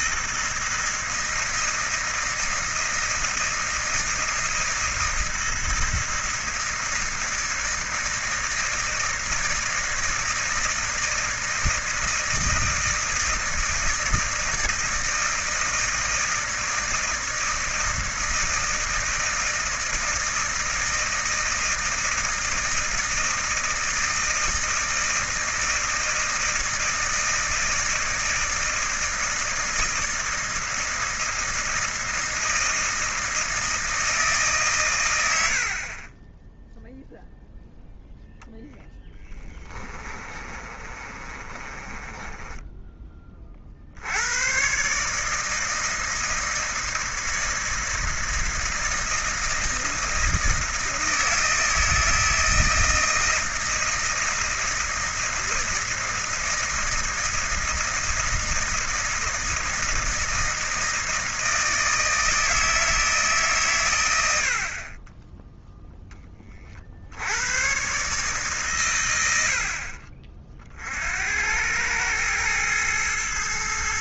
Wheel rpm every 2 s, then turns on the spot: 160, 160, 160, 160, 160, 160, 160, 160, 160, 160, 160, 160, 160, 160, 160, 160, 160, 130, 0, 10, 30, 10, 130, 160, 160, 160, 160, 160, 160, 160, 160, 160, 40, 50, 110, 50, 110.
40-44